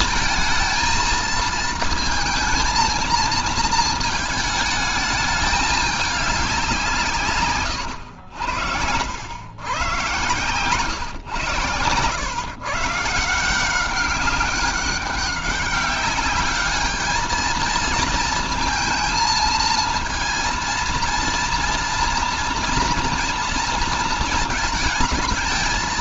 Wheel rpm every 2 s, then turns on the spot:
220, 230, 220, 190, 100, 130, 140, 200, 210, 230, 230, 230, 230.
none